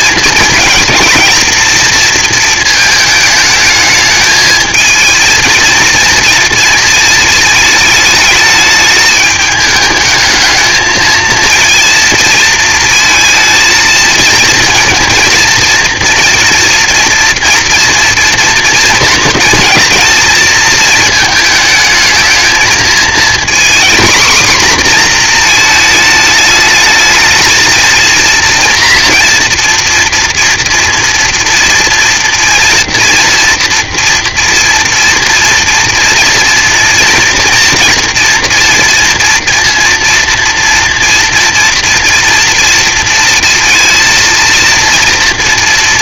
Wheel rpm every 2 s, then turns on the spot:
230, 230, 220, 230, 210, 220, 230, 230, 230, 230, 220, 220, 250, 220, 230, 230, 230, 230, 230, 230, 230, 230, 230.
none